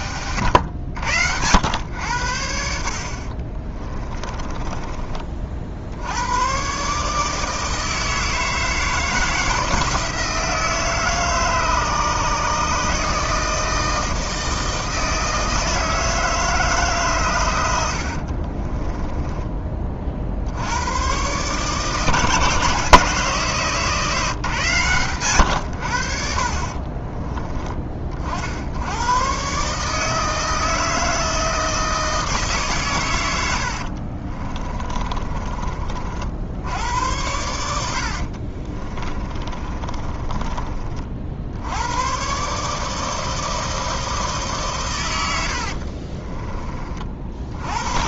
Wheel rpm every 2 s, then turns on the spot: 100, 60, 30, 130, 160, 160, 150, 160, 140, 20, 90, 160, 130, 30, 90, 160, 130, 30, 90, 40, 30, 150, 130, 40.
4-6 18-20 26-28 34-36 38-40